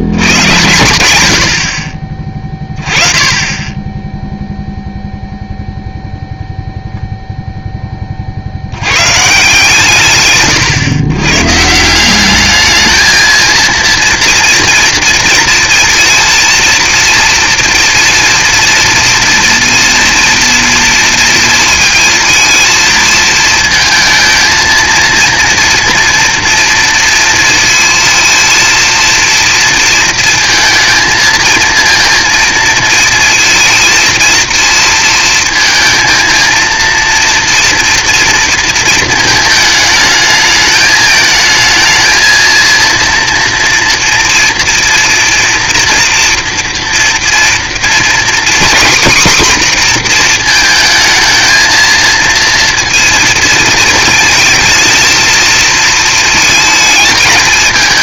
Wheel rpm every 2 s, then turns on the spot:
100, 20, 0, 0, 70, 130, 210, 230, 230, 230, 230, 230, 230, 230, 230, 230, 230, 230, 230, 230, 220, 230, 230, 240, 240, 230, 230, 220, 220.
none